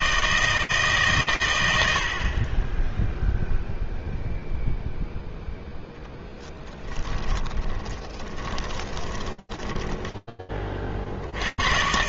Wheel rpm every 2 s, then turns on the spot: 130, 0, 0, 10, 10, 110.
6-10